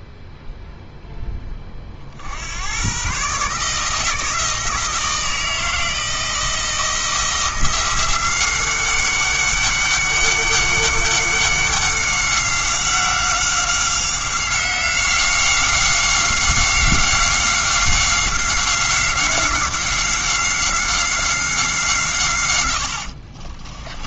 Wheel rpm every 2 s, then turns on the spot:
0, 100, 160, 160, 190, 200, 190, 190, 190, 190, 190, 90.
none